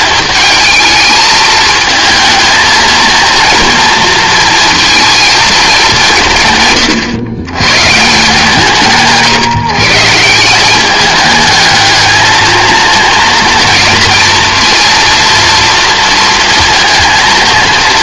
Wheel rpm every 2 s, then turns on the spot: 210, 220, 230, 130, 160, 190, 220, 230, 230.
none